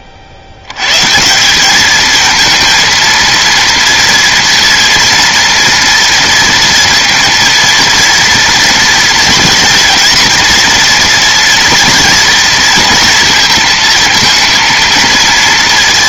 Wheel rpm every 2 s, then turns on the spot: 80, 230, 230, 230, 230, 230, 230, 230.
none